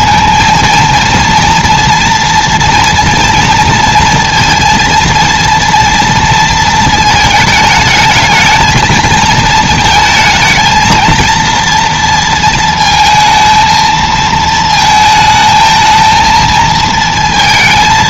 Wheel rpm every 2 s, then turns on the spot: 230, 230, 230, 220, 220, 220, 220, 220, 230.
none